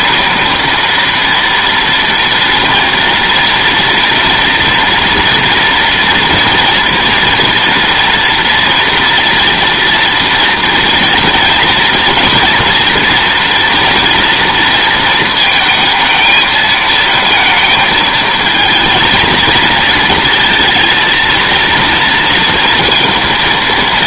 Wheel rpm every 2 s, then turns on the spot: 230, 230, 240, 230, 240, 230, 240, 230, 220, 220, 230, 230.
none